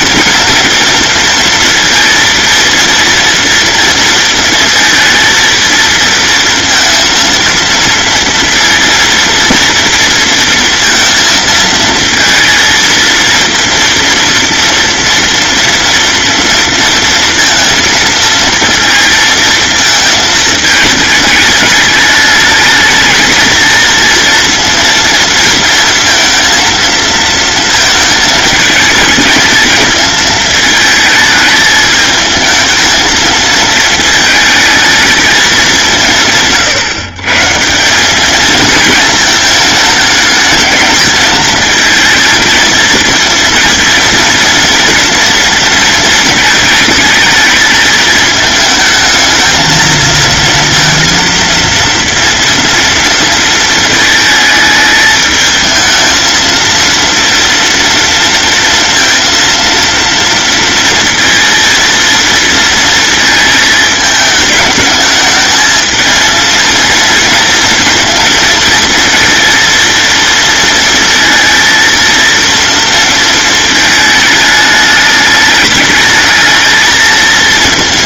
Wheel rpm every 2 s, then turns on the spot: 230, 230, 230, 230, 230, 230, 230, 230, 230, 230, 210, 230, 230, 230, 220, 220, 220, 220, 140, 220, 220, 230, 230, 220, 220, 230, 230, 220, 230, 230, 230, 230, 210, 230, 230, 230, 230, 210, 220.
none